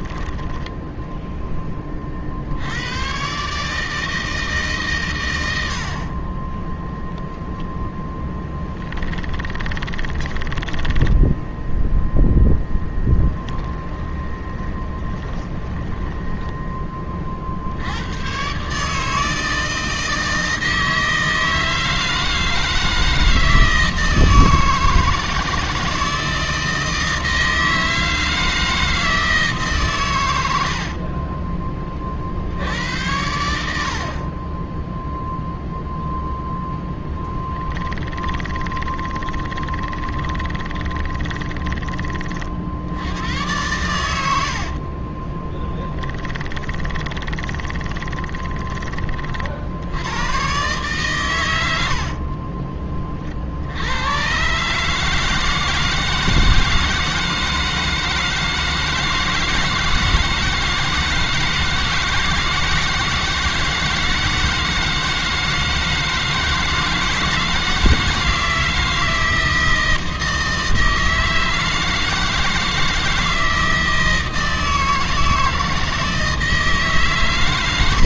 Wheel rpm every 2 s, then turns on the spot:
10, 90, 140, 10, 10, 10, 10, 20, 20, 140, 160, 160, 160, 160, 160, 70, 80, 20, 10, 20, 20, 70, 50, 20, 30, 110, 30, 140, 160, 160, 160, 160, 160, 160, 160, 160, 160, 160, 160.
8-16 30-32 36-42 44-48 52-54